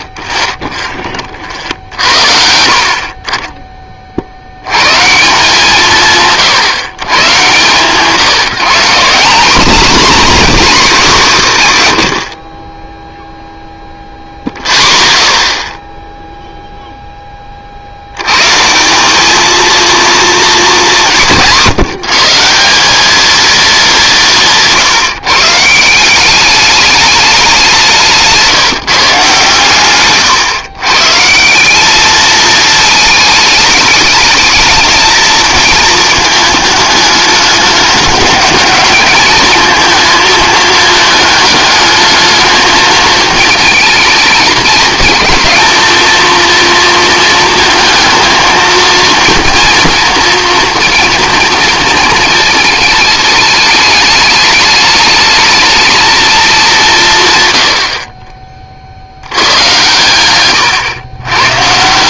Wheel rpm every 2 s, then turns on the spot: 40, 40, 130, 120, 180, 240, 20, 0, 0, 160, 190, 190, 160, 200, 160, 120, 220, 220, 210, 220, 220, 220, 220, 230, 230, 230, 220, 210, 200, 40, 120.
none